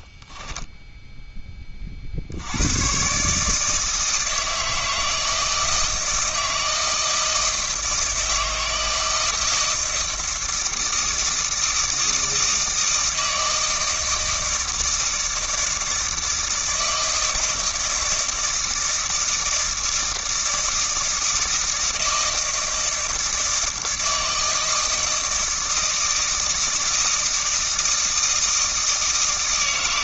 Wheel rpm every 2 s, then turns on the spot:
10, 90, 160, 160, 160, 160, 160, 160, 160, 160, 160, 160, 160, 160, 160.
0-2